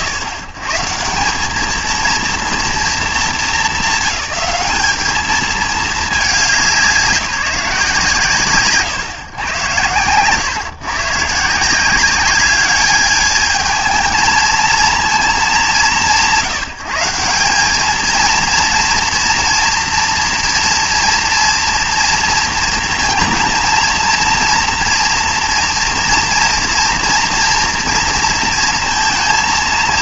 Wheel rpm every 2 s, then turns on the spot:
120, 230, 210, 180, 140, 130, 200, 220, 150, 230, 230, 230, 230, 230, 230.
none